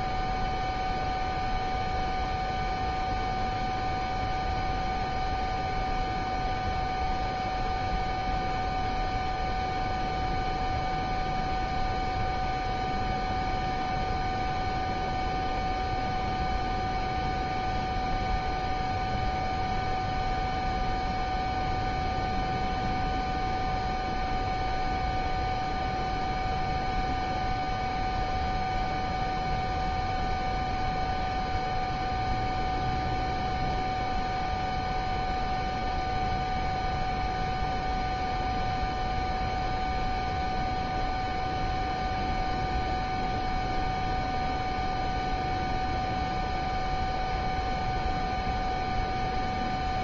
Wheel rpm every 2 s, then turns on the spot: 0, 0, 0, 0, 0, 0, 0, 0, 0, 0, 0, 0, 0, 0, 0, 0, 0, 0, 0, 0, 0, 0, 0, 0, 0.
none